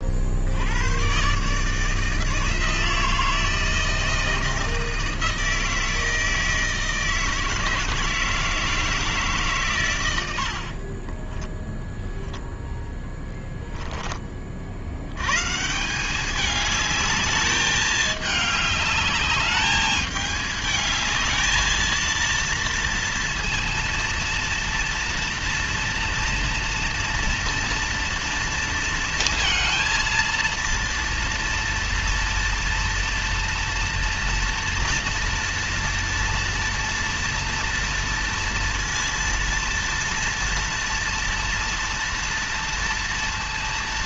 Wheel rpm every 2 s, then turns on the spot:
60, 160, 160, 160, 160, 80, 0, 50, 190, 210, 210, 230, 230, 230, 230, 230, 230, 230, 230, 230, 240, 230.
none